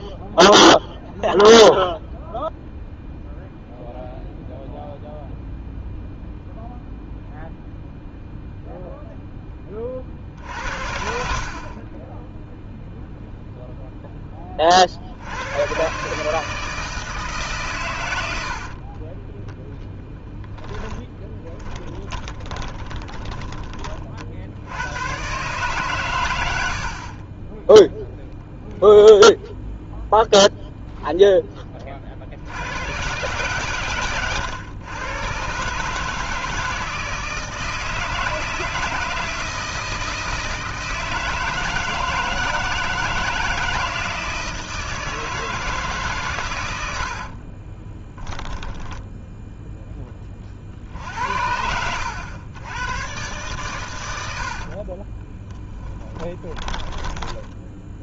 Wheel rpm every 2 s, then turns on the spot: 0, 0, 0, 0, 0, 70, 0, 50, 160, 40, 10, 20, 100, 60, 0, 0, 100, 120, 160, 160, 160, 160, 160, 90, 10, 60, 110, 40, 10.
18-24 26-28 48-50 54-58